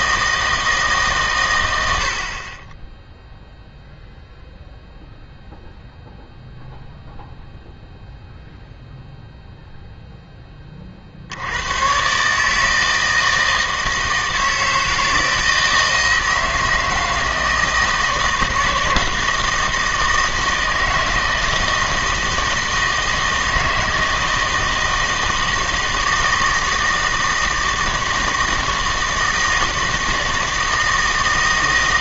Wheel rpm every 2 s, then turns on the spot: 160, 10, 0, 0, 0, 40, 160, 160, 160, 160, 160, 160, 160, 160, 160, 160.
none